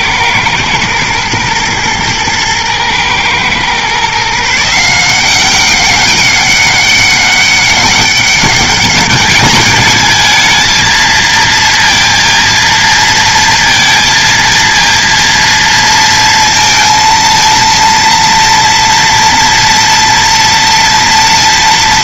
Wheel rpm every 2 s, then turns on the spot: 120, 110, 170, 200, 200, 220, 230, 230, 230, 240, 230.
none